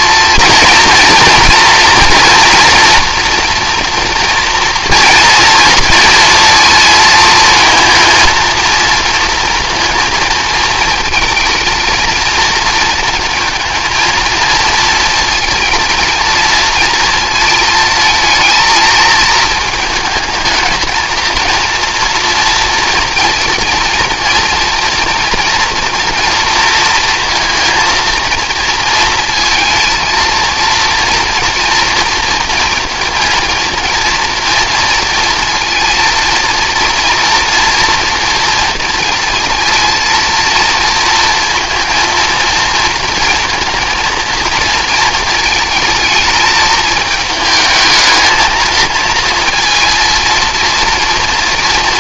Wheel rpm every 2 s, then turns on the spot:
230, 230, 230, 230, 230, 230, 220, 230, 230, 220, 220, 230, 230, 230, 230, 230, 230, 230, 230, 230, 230, 230, 230, 220, 230, 230.
none